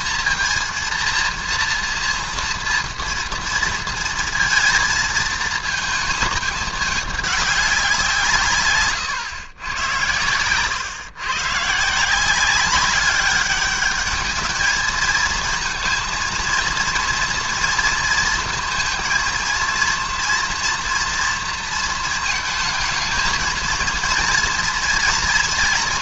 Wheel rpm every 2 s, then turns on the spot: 230, 230, 220, 210, 170, 100, 170, 210, 230, 230, 230, 230, 230.
none